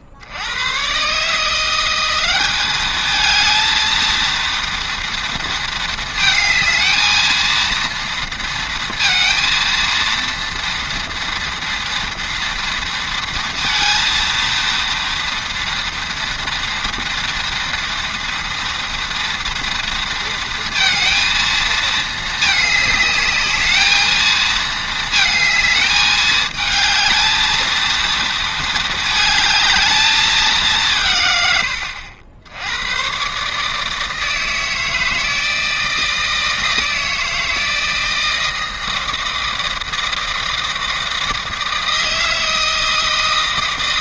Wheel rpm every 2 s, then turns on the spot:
110, 210, 230, 220, 230, 230, 230, 230, 230, 230, 230, 210, 220, 220, 220, 170, 90, 160, 160, 160, 160, 160.
none